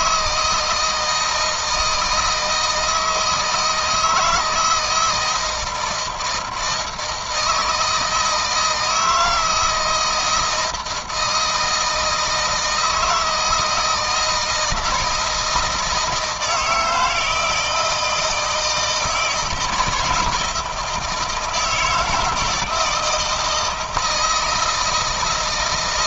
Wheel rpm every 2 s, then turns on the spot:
160, 160, 160, 160, 160, 160, 160, 160, 160, 160, 160, 160, 170.
none